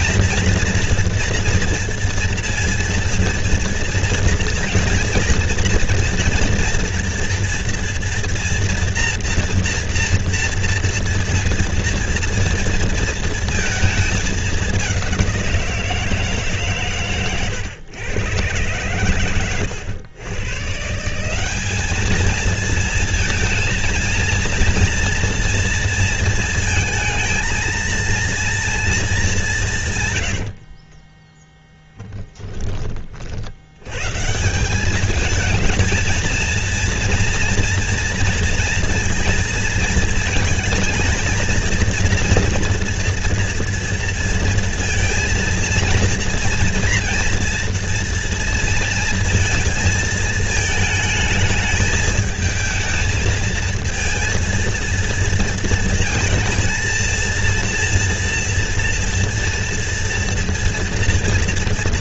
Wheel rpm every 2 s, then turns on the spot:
230, 230, 230, 240, 230, 230, 230, 210, 150, 120, 130, 230, 230, 230, 230, 80, 10, 170, 230, 230, 230, 240, 230, 230, 230, 220, 220, 230, 230, 230, 230.
30-32